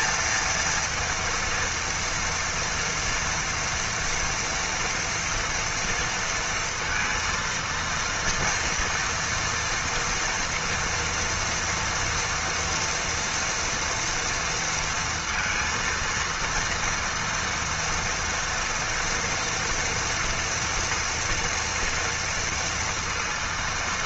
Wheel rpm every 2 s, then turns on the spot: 230, 230, 230, 230, 230, 230, 240, 230, 230, 230, 230, 230.
none